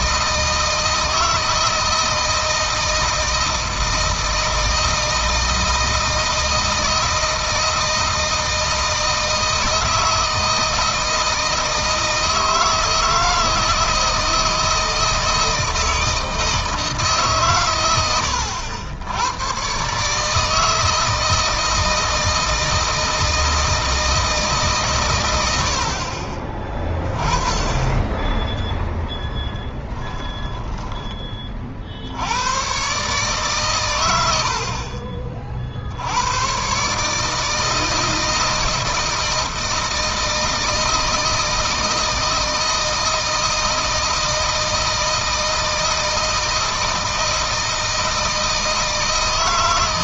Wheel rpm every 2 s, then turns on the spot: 160, 160, 160, 160, 160, 160, 160, 160, 160, 80, 160, 160, 140, 20, 10, 20, 120, 60, 120, 160, 160, 160, 160, 160, 160.
30-32